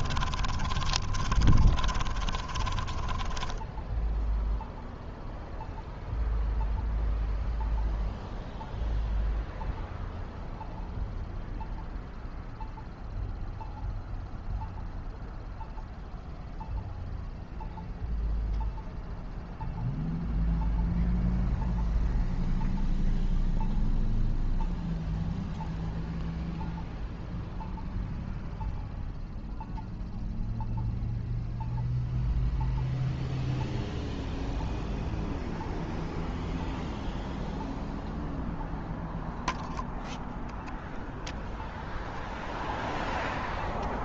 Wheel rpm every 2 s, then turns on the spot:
20, 30, 0, 0, 0, 0, 0, 0, 0, 0, 0, 0, 0, 0, 0, 0, 0, 0, 0, 0, 0, 0.
0-4